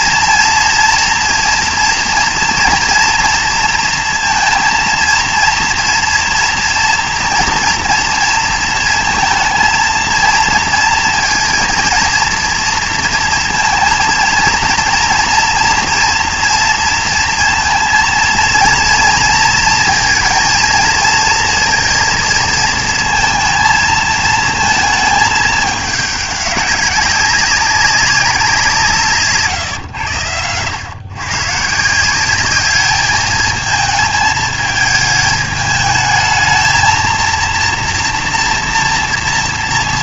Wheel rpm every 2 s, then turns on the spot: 240, 230, 230, 240, 230, 230, 230, 230, 230, 230, 230, 230, 220, 200, 180, 110, 200, 220, 220, 230.
none